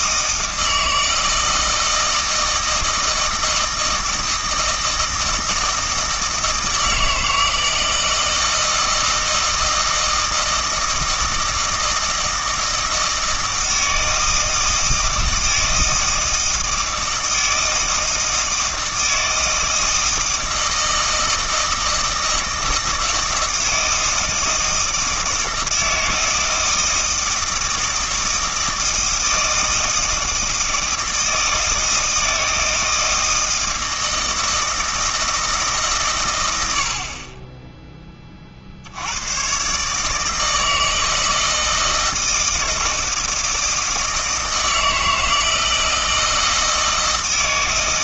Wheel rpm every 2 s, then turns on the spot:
160, 160, 160, 160, 160, 160, 160, 160, 160, 160, 160, 160, 160, 160, 160, 160, 160, 160, 80, 60, 160, 160, 160, 160.
none